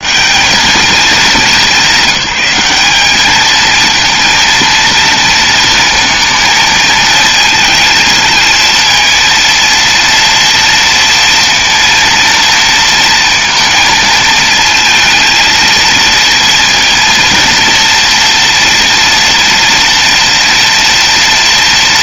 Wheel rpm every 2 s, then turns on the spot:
220, 210, 230, 230, 230, 230, 230, 220, 230, 230, 230.
none